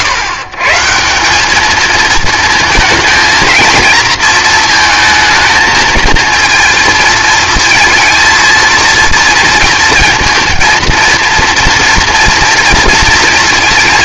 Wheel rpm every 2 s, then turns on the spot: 140, 230, 230, 230, 220, 230, 230.
none